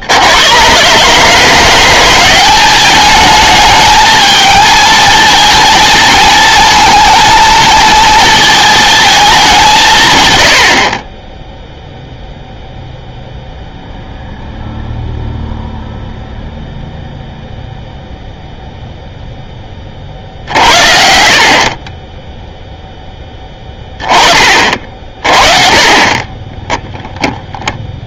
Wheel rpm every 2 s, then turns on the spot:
120, 200, 220, 230, 220, 70, 0, 0, 0, 0, 70, 0, 40, 10.
26-28